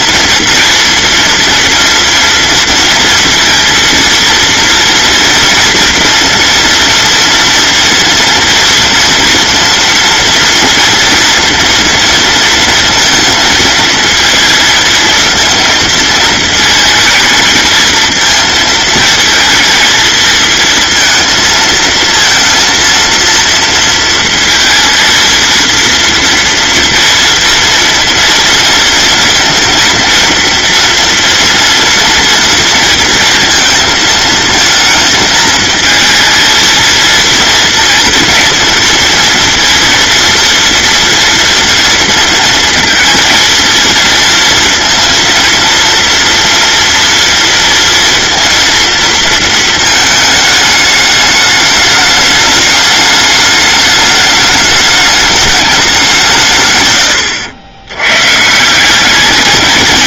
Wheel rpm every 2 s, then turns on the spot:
230, 230, 230, 230, 240, 230, 230, 220, 220, 220, 220, 230, 230, 230, 240, 240, 230, 220, 230, 230, 230, 230, 230, 230, 230, 210, 210, 210, 140, 160.
none